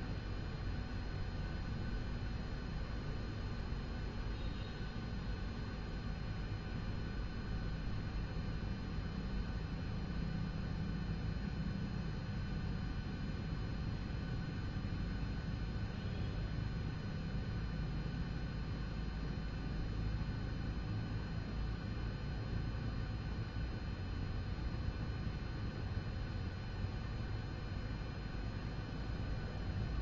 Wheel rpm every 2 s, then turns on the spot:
0, 0, 0, 0, 0, 0, 0, 0, 0, 0, 0, 0, 0, 0, 0.
none